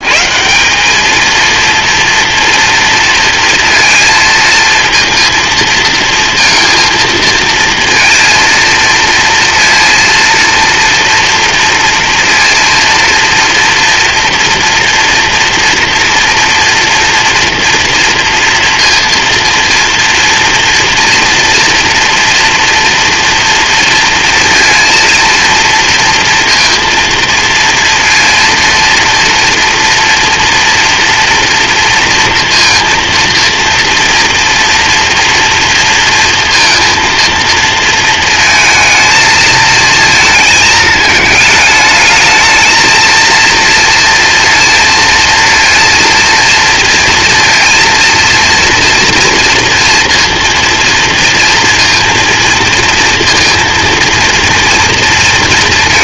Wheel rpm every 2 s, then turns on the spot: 180, 230, 230, 230, 230, 230, 230, 240, 240, 230, 230, 230, 230, 230, 230, 230, 230, 230, 230, 220, 220, 220, 230, 230, 230, 230, 230, 230.
none